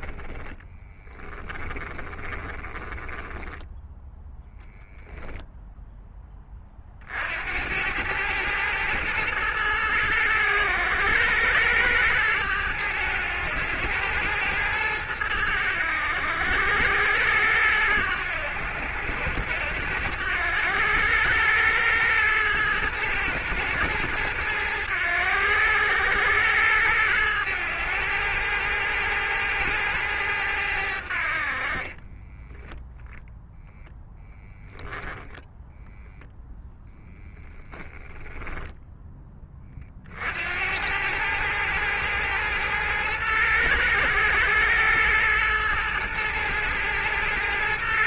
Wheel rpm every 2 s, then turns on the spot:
10, 20, 0, 30, 110, 100, 110, 110, 90, 90, 100, 110, 100, 100, 110, 90, 10, 0, 0, 10, 90, 110, 110, 110.
0-4